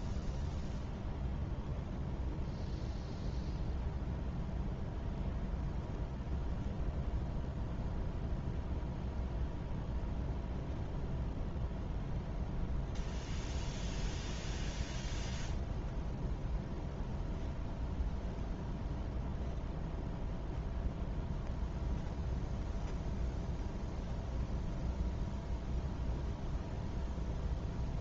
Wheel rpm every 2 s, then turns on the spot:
0, 0, 0, 0, 0, 0, 0, 0, 0, 0, 0, 0, 0, 0.
none